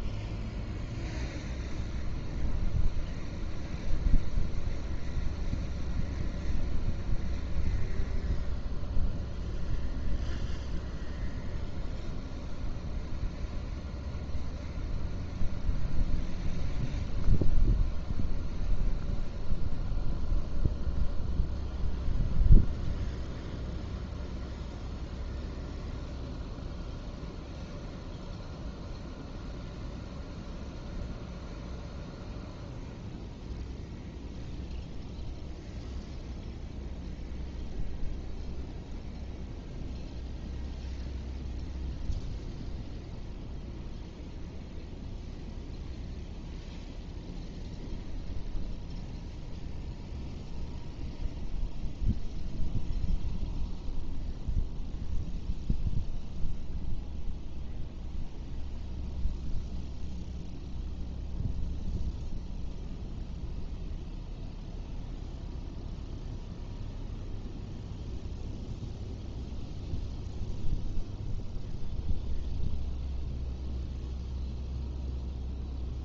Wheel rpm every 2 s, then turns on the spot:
0, 0, 0, 0, 0, 0, 0, 0, 0, 0, 0, 0, 0, 0, 0, 0, 0, 0, 0, 0, 0, 0, 0, 0, 0, 0, 0, 0, 0, 0, 0, 0, 0, 0, 0, 0, 0, 0.
none